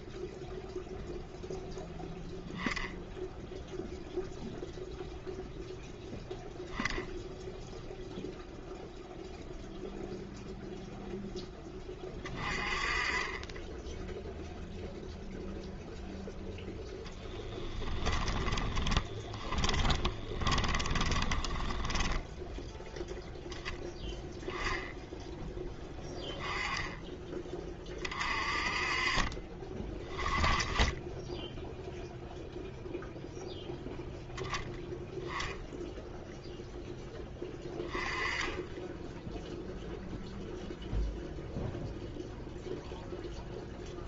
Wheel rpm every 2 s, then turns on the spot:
0, 0, 0, 0, 0, 0, 30, 0, 0, 20, 10, 10, 10, 10, 40, 10, 0, 0, 0, 10, 0, 0.
18-22